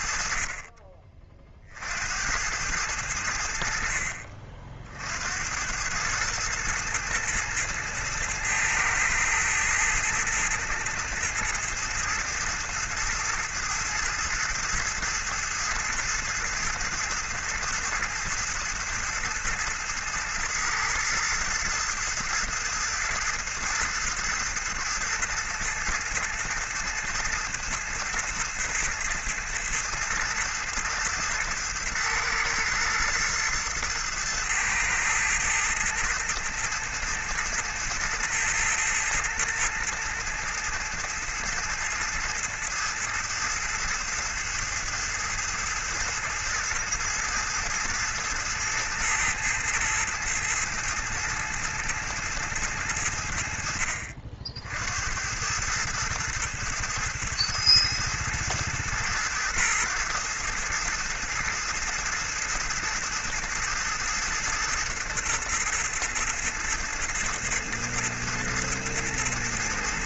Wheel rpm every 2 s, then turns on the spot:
30, 90, 50, 110, 110, 110, 110, 110, 110, 110, 110, 110, 110, 110, 110, 110, 110, 110, 110, 110, 110, 110, 110, 110, 110, 110, 100, 70, 110, 110, 110, 110, 110, 110, 110.
none